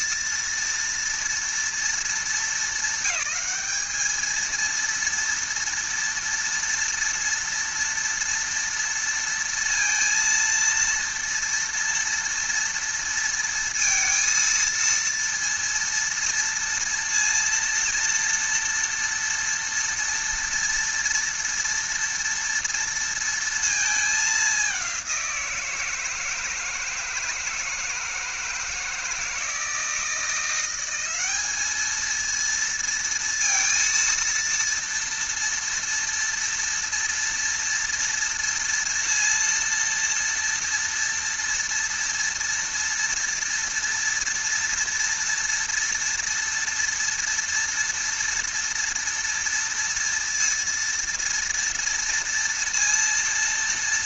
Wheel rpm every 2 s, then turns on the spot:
230, 210, 220, 230, 230, 230, 230, 230, 230, 230, 230, 230, 200, 160, 160, 180, 230, 230, 230, 230, 230, 230, 230, 230, 230, 230, 230.
none